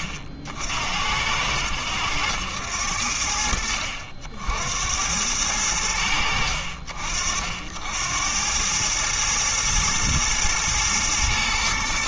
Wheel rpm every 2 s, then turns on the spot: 60, 80, 80, 60, 100, 110.
none